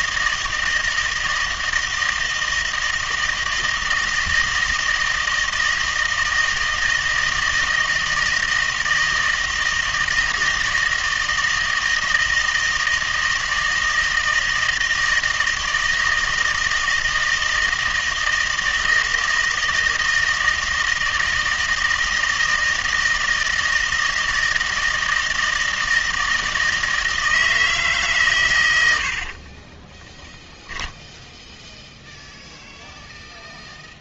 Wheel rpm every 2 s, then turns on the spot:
160, 160, 160, 160, 160, 160, 160, 160, 160, 160, 160, 160, 160, 160, 110, 0, 0.
none